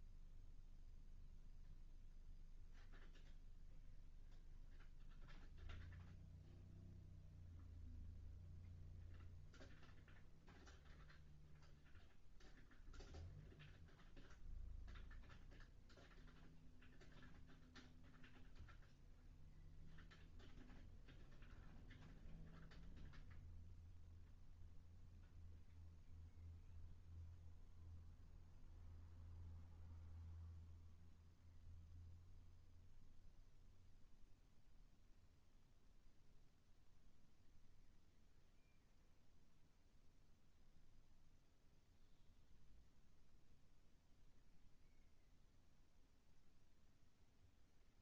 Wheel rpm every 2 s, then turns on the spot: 0, 0, 0, 0, 0, 0, 0, 0, 0, 0, 0, 0, 0, 0, 0, 0, 0, 0, 0, 0, 0, 0, 0, 0.
none